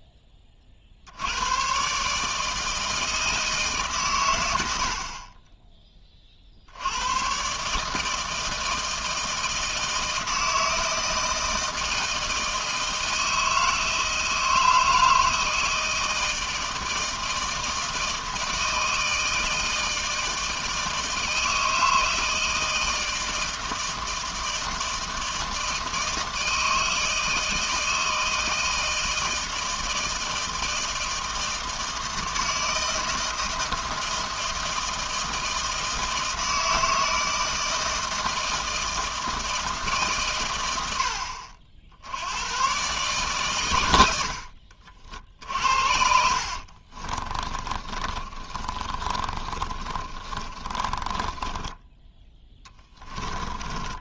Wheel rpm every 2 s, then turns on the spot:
50, 160, 70, 90, 160, 160, 160, 160, 160, 160, 160, 160, 160, 160, 160, 160, 160, 160, 160, 160, 100, 130, 60, 40, 30, 20, 20.
46-54